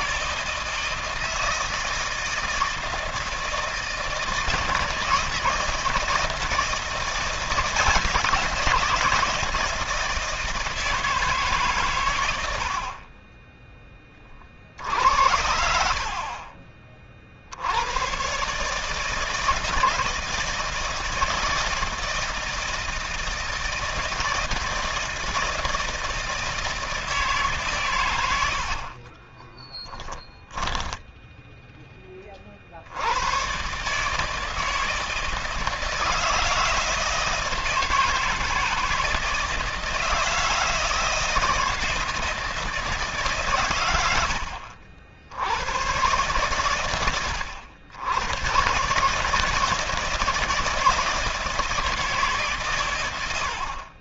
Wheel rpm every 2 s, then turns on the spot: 160, 160, 160, 170, 170, 160, 40, 70, 40, 150, 160, 160, 160, 160, 40, 10, 80, 160, 160, 160, 160, 150, 70, 110, 140, 160, 110.
28-32